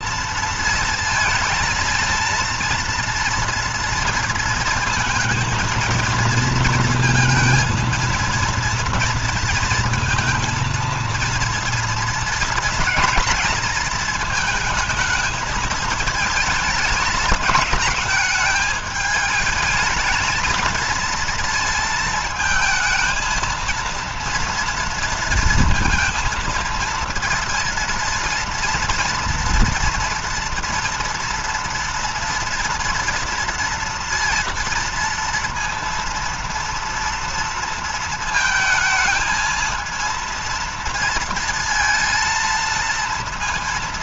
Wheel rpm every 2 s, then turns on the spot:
230, 230, 230, 230, 240, 230, 230, 220, 220, 220, 220, 220, 230, 230, 230, 240, 230, 230, 230, 220, 230, 230.
none